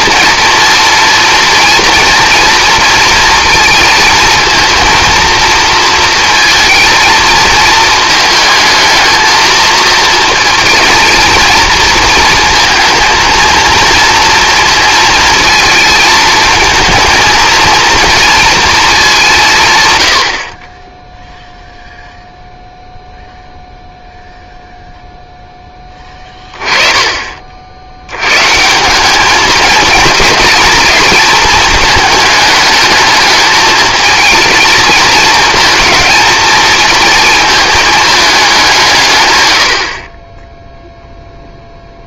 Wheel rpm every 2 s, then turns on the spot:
240, 230, 230, 230, 220, 230, 230, 230, 220, 220, 30, 0, 0, 20, 160, 220, 220, 220, 220, 180, 0.
none